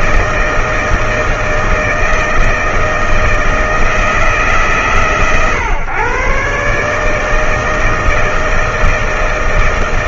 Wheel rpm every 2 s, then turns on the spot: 160, 160, 140, 140, 160.
none